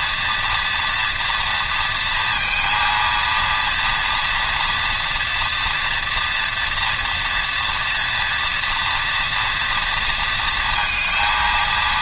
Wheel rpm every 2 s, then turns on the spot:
240, 230, 230, 230, 240, 230.
none